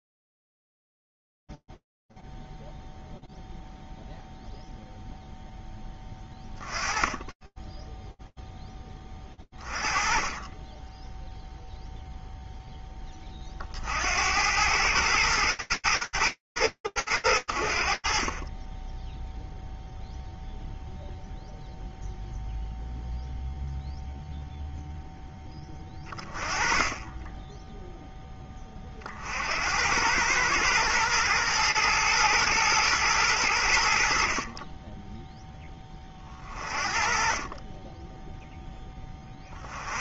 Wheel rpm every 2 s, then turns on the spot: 0, 0, 0, 10, 0, 30, 0, 70, 110, 50, 0, 0, 0, 30, 40, 110, 110, 10, 30, 50.
none